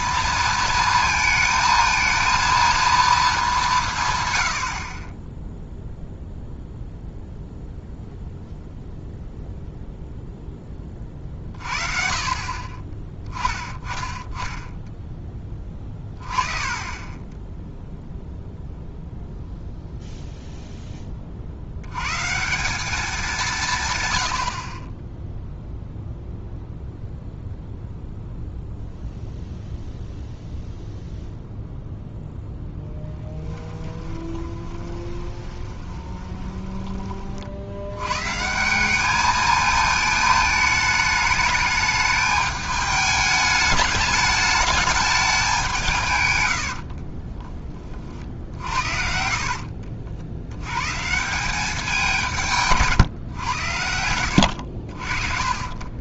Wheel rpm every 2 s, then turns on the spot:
230, 230, 50, 0, 0, 20, 40, 10, 30, 0, 10, 180, 40, 0, 0, 0, 10, 20, 20, 180, 210, 210, 210, 80, 60, 100, 150, 70.
34-38 46-50